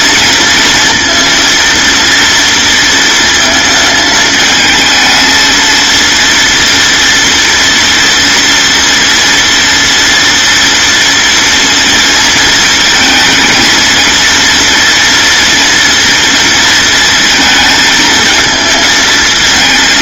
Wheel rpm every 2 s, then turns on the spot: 230, 230, 220, 240, 230, 230, 230, 230, 230, 220.
none